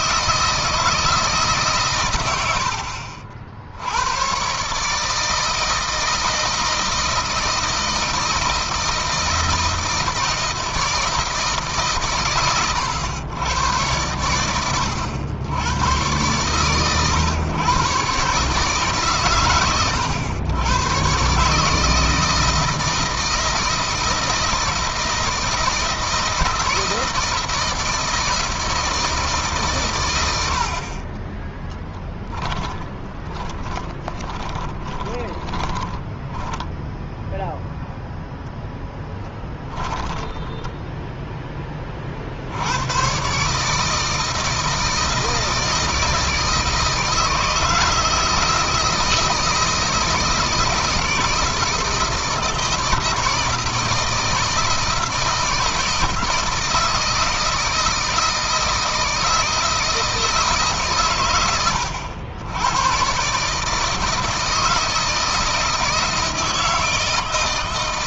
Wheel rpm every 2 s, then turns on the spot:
160, 80, 140, 160, 160, 160, 120, 100, 120, 140, 110, 160, 160, 170, 160, 60, 10, 20, 0, 0, 10, 90, 160, 160, 160, 160, 160, 160, 160, 160, 150, 110, 160, 160.
32-36